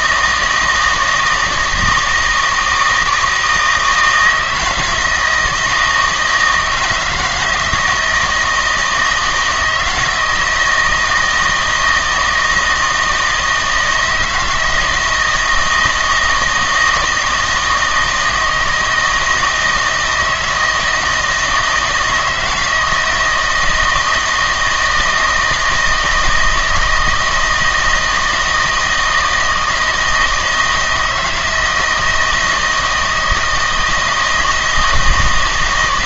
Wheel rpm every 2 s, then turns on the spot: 160, 160, 160, 160, 160, 160, 160, 160, 170, 160, 160, 160, 160, 160, 160, 160, 160, 160.
none